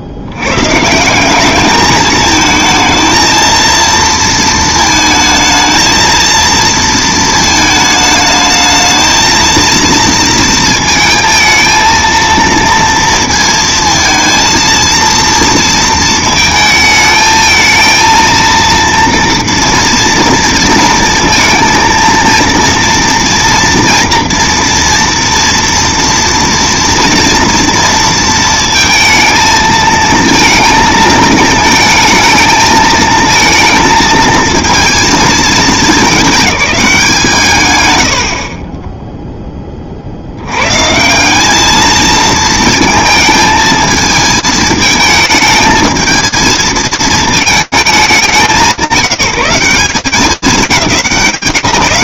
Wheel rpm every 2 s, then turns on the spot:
90, 220, 230, 230, 220, 230, 230, 230, 220, 230, 230, 230, 230, 230, 230, 220, 230, 230, 210, 70, 80, 220, 220, 220, 200, 150.
none